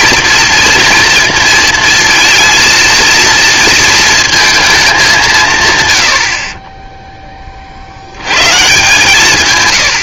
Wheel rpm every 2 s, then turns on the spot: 230, 230, 220, 30, 140.
6-8